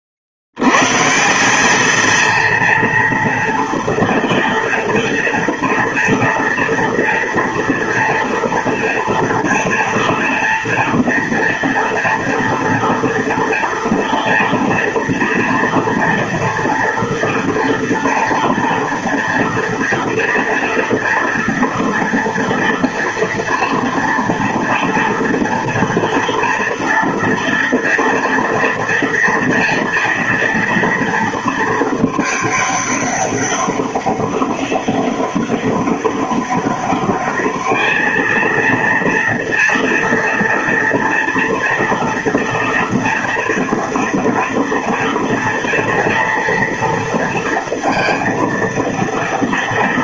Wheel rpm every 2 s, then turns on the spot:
100, 230, 230, 230, 230, 230, 230, 230, 230, 230, 230, 230, 230, 230, 240, 230, 210, 200, 200, 230, 230, 230, 230, 230, 230.
none